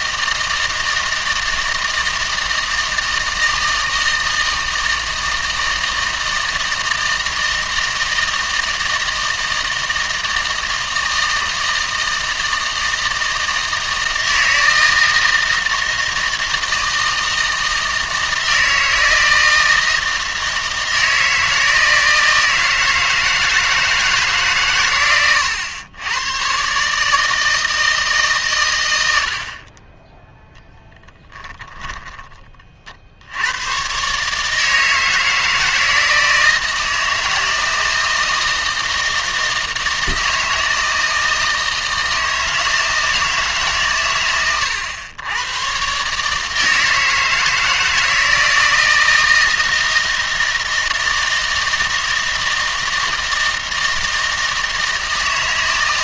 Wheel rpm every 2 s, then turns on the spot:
160, 160, 160, 160, 160, 160, 160, 160, 160, 160, 160, 160, 130, 140, 100, 10, 50, 160, 160, 160, 160, 160, 110, 160, 160, 160, 160, 160.
none